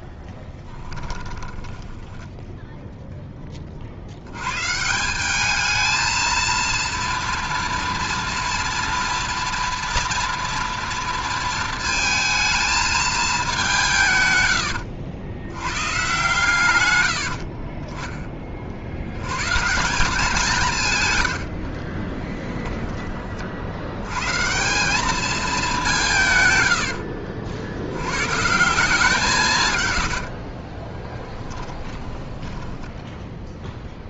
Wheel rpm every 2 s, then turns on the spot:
20, 10, 120, 230, 240, 230, 220, 90, 130, 30, 170, 10, 150, 110, 170, 40, 10.
0-2 22-24 30-32